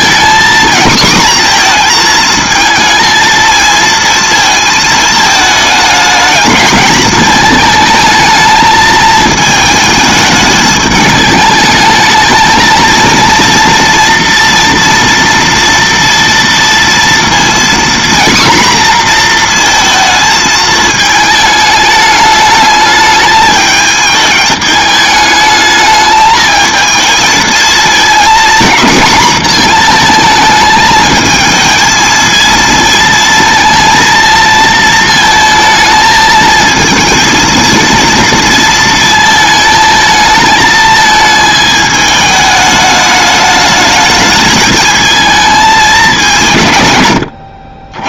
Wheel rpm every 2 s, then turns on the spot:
240, 220, 220, 210, 220, 210, 220, 230, 230, 240, 220, 210, 210, 220, 240, 220, 220, 220, 220, 230, 220, 210, 220, 140.
none